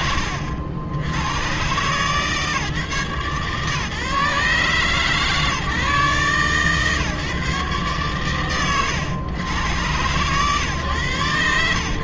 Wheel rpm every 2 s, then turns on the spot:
110, 140, 150, 150, 110, 110.
none